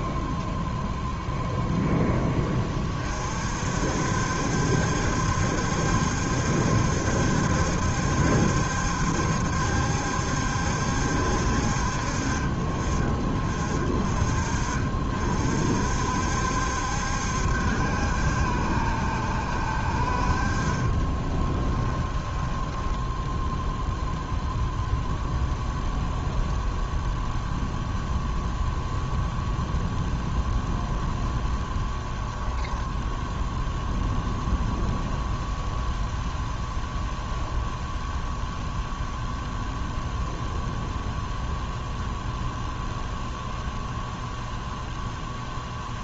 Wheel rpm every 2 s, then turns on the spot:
0, 20, 70, 70, 70, 70, 40, 40, 70, 70, 40, 10, 0, 0, 0, 0, 20, 0, 0, 0, 0, 0, 0.
22-24